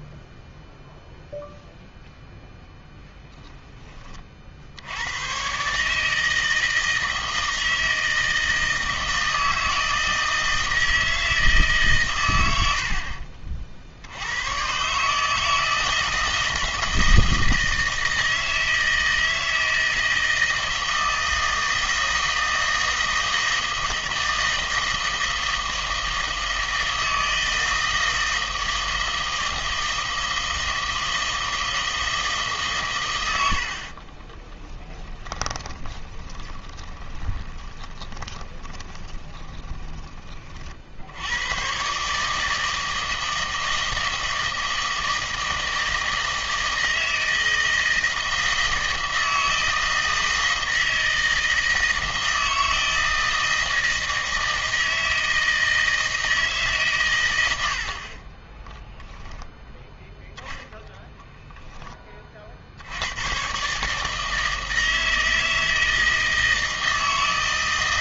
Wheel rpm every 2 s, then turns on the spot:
0, 0, 70, 160, 160, 160, 80, 120, 160, 160, 160, 160, 160, 160, 160, 160, 140, 10, 20, 20, 50, 160, 160, 160, 160, 160, 160, 160, 150, 20, 0, 60, 160, 160.
34-40 58-60